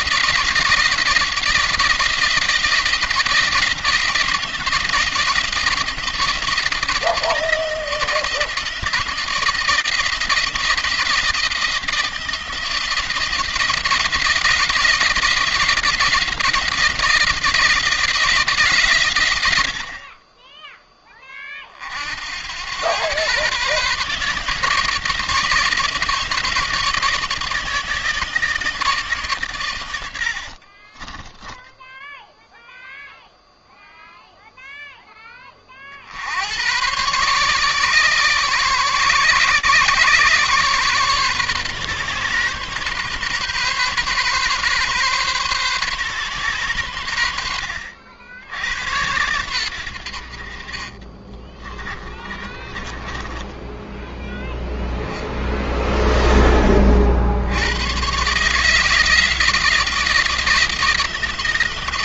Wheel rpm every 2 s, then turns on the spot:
170, 170, 160, 160, 160, 170, 170, 170, 170, 110, 20, 120, 160, 150, 140, 20, 0, 10, 130, 130, 130, 130, 130, 90, 100, 30, 20, 10, 60, 160, 170.
50-52 54-56